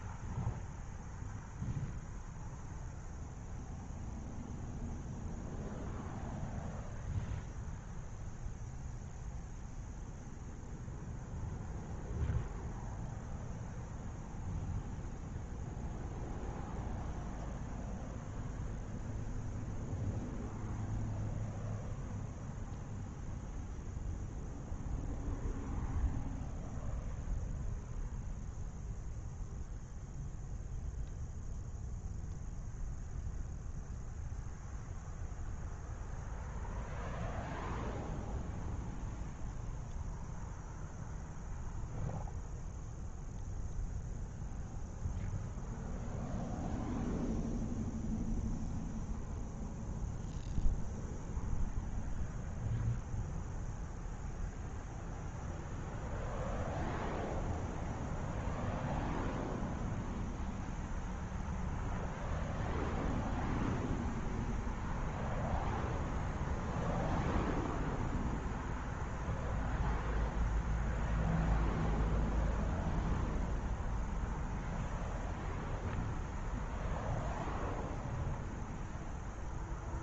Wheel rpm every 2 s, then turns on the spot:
0, 0, 0, 0, 0, 0, 0, 0, 0, 0, 0, 0, 0, 0, 0, 0, 0, 0, 0, 0, 0, 0, 0, 0, 0, 0, 0, 0, 0, 0, 0, 0, 0, 0, 0, 0, 0, 0, 0, 0.
none